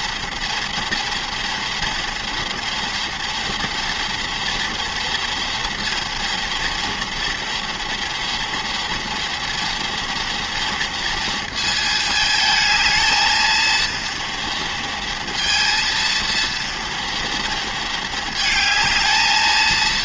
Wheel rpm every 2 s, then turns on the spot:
240, 230, 230, 240, 230, 230, 220, 230, 230, 220.
none